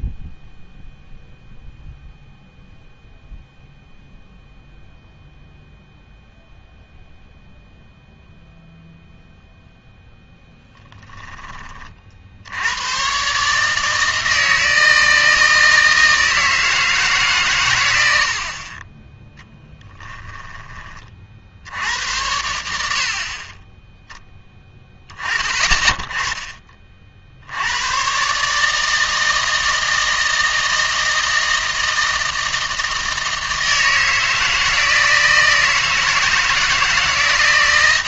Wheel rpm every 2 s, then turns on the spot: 0, 0, 0, 0, 0, 20, 90, 160, 160, 30, 20, 80, 10, 30, 150, 160, 160, 160, 160.
none